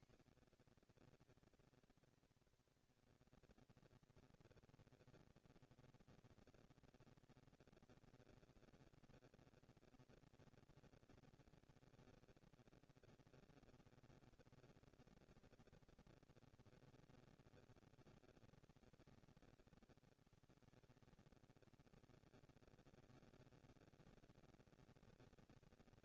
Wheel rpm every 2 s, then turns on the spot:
240, 210, 230, 230, 240, 230, 230, 230, 230, 200, 120, 170, 230.
none